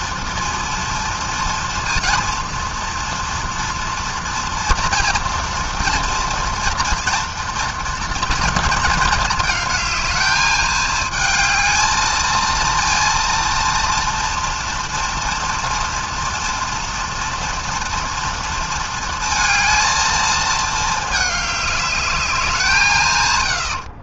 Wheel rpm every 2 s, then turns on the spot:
230, 230, 230, 240, 230, 220, 230, 240, 230, 230, 220, 180.
none